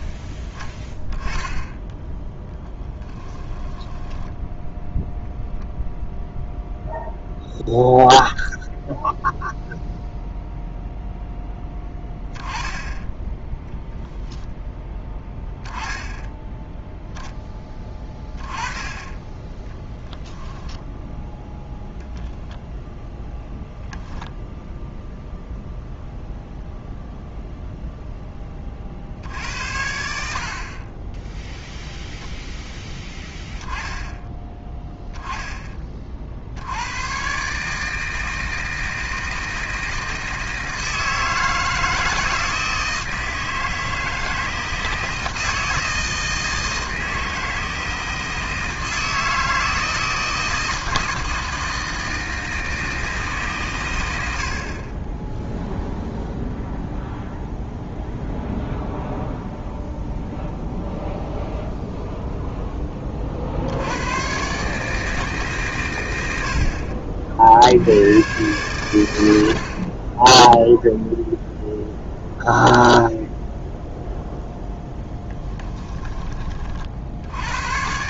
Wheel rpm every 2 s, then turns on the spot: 10, 10, 0, 0, 0, 0, 10, 10, 0, 10, 10, 0, 0, 0, 40, 20, 10, 10, 100, 160, 160, 160, 160, 160, 160, 160, 160, 40, 0, 0, 0, 20, 150, 50, 100, 0, 0, 10, 60.
2-4 20-22 74-76